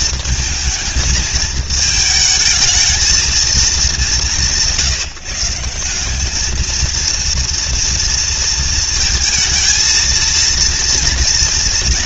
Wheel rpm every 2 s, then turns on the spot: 220, 220, 140, 220, 230, 230.
none